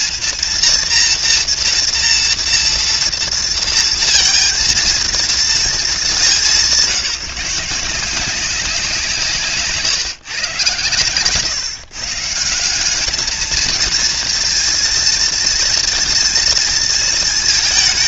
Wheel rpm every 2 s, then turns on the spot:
240, 230, 230, 180, 170, 120, 190, 230, 230.
none